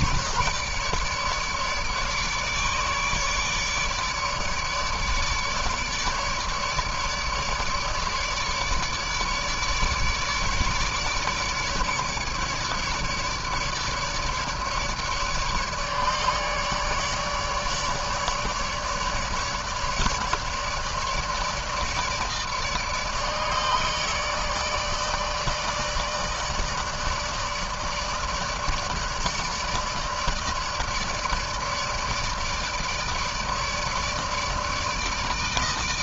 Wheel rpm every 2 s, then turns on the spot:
150, 150, 150, 150, 150, 150, 150, 150, 150, 150, 150, 150, 160, 160, 150, 160, 150, 150.
none